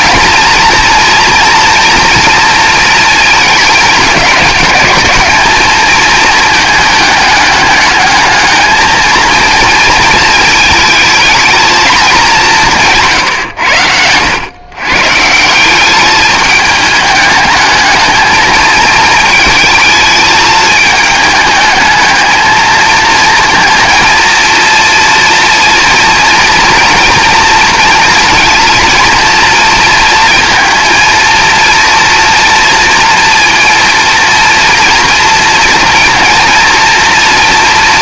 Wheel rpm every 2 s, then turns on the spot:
230, 230, 200, 210, 220, 220, 160, 130, 210, 220, 220, 220, 230, 230, 230, 230, 230, 230, 230.
none